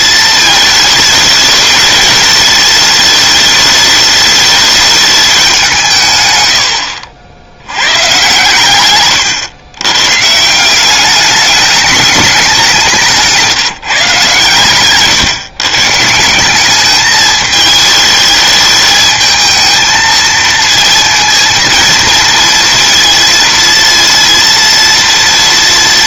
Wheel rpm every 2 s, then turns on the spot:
220, 210, 210, 70, 120, 180, 190, 130, 200, 220, 230, 230, 230.
none